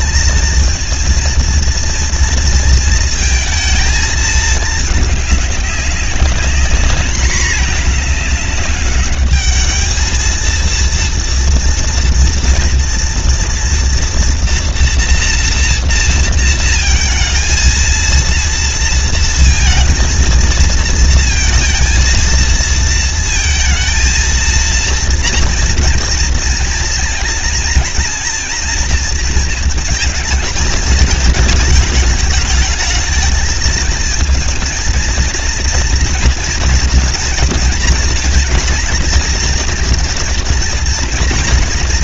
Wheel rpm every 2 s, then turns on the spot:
230, 230, 210, 200, 210, 230, 230, 230, 230, 230, 230, 220, 230, 230, 230, 220, 210, 230, 230, 230, 230.
none